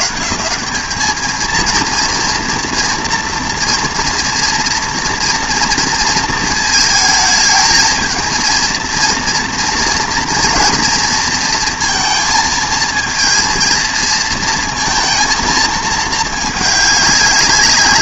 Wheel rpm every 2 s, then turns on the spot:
130, 230, 230, 220, 230, 240, 230, 230, 210.
none